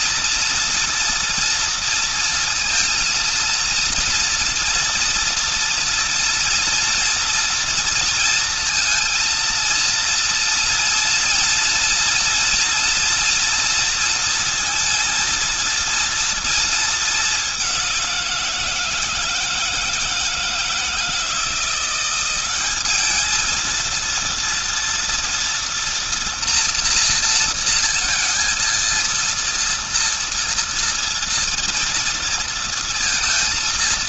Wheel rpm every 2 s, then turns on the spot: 230, 230, 230, 230, 230, 230, 240, 230, 210, 160, 160, 210, 230, 230, 230, 230, 230.
none